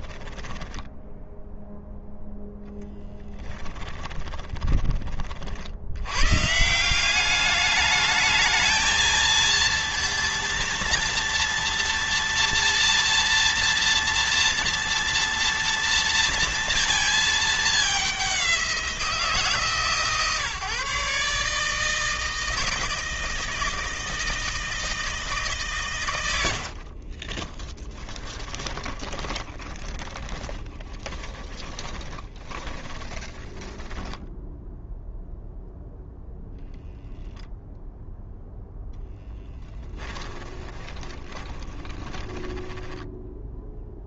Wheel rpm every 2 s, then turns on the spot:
10, 10, 30, 180, 220, 230, 230, 230, 220, 160, 140, 160, 160, 40, 20, 20, 20, 0, 0, 0, 30, 10.
0-2 26-34 40-42